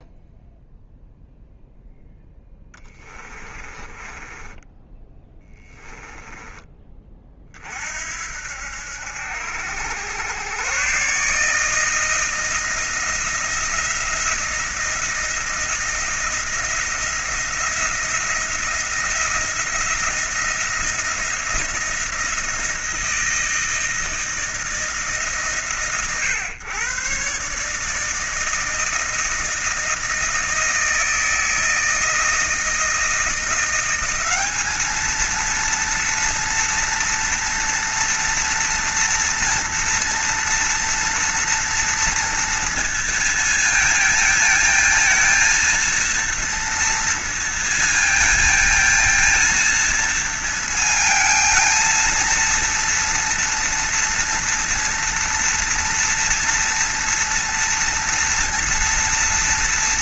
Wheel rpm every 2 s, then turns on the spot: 0, 10, 10, 20, 70, 120, 170, 170, 170, 170, 170, 170, 160, 120, 160, 160, 160, 210, 230, 230, 230, 230, 230, 230, 230, 220, 230, 230, 230, 230.
2-6